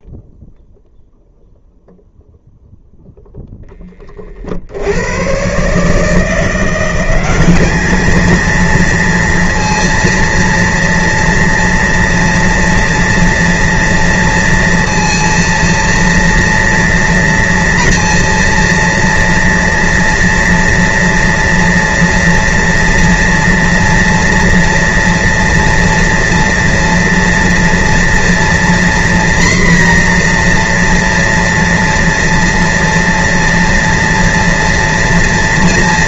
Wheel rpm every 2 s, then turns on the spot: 0, 0, 70, 180, 230, 230, 230, 230, 230, 230, 230, 240, 230, 230, 240, 240, 230, 230.
none